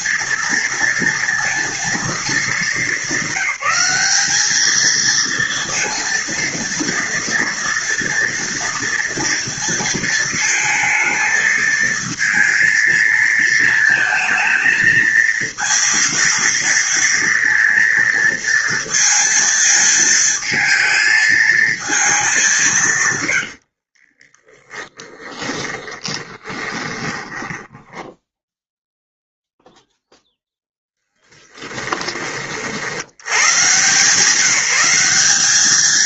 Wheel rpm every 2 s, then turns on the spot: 230, 210, 210, 230, 230, 230, 230, 220, 230, 230, 220, 180, 20, 20, 0, 0, 50, 180.
24-28